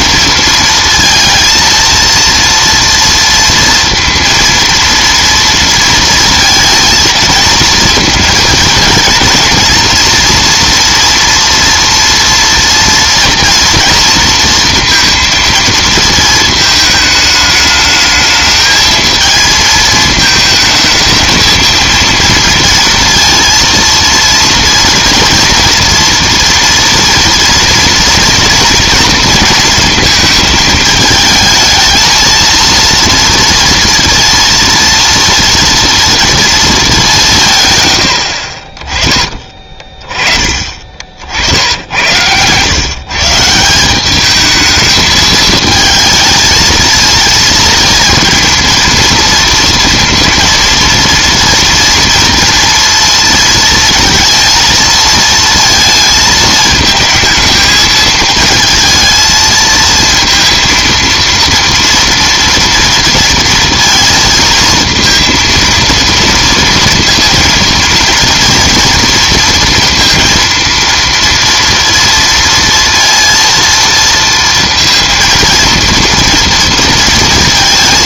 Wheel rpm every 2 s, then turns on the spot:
230, 230, 230, 230, 230, 230, 230, 230, 220, 220, 220, 230, 230, 230, 230, 220, 230, 230, 220, 30, 30, 110, 210, 220, 230, 230, 230, 230, 220, 220, 230, 230, 230, 230, 230, 230, 230, 230, 230.
none